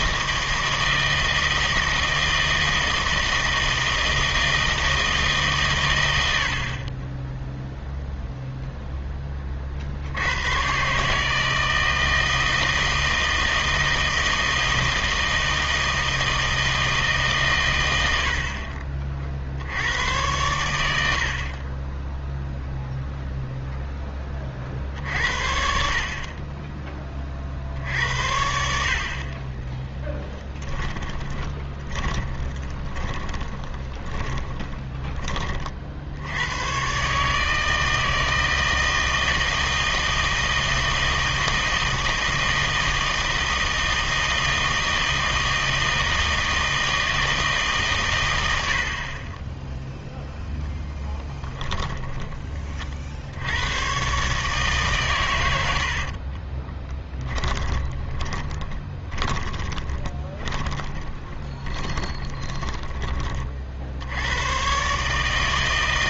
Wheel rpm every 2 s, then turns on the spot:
160, 160, 160, 50, 0, 110, 160, 160, 160, 40, 90, 0, 50, 20, 60, 10, 30, 30, 110, 160, 160, 160, 160, 160, 80, 0, 30, 150, 20, 20, 10, 20, 110.
30-36 56-64